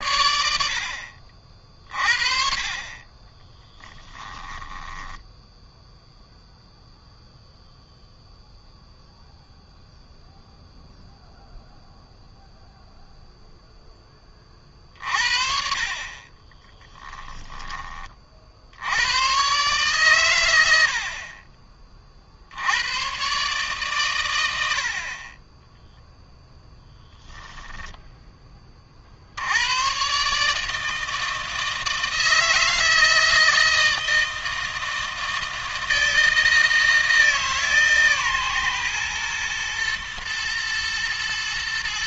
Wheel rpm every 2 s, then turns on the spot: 60, 30, 10, 0, 0, 0, 0, 40, 10, 90, 70, 90, 60, 0, 40, 160, 160, 160, 160, 120, 110.
2-6 16-18